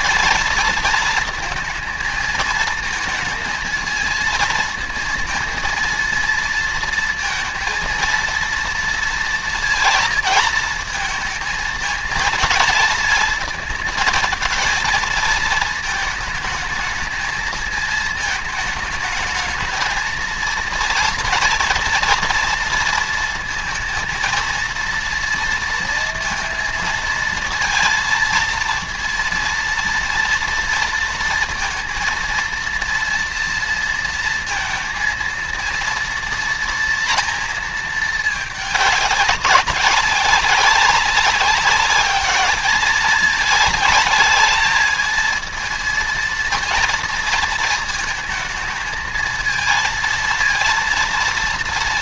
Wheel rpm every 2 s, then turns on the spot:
230, 230, 230, 230, 230, 230, 230, 230, 220, 220, 230, 230, 230, 230, 230, 230, 230, 230, 230, 200, 190, 210, 220, 230, 230, 230.
none